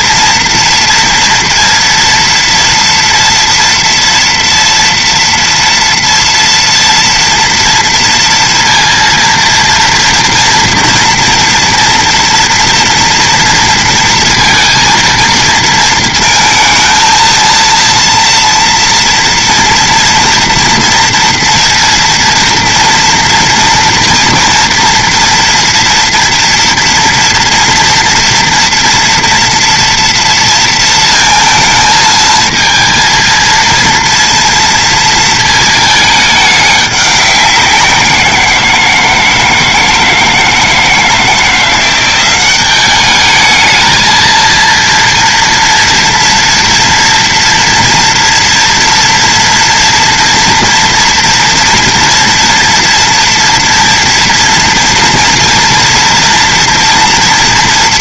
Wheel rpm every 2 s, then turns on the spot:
230, 230, 230, 230, 230, 230, 230, 230, 230, 230, 230, 230, 230, 230, 230, 230, 230, 230, 210, 170, 160, 180, 220, 230, 230, 230, 230, 230, 230.
none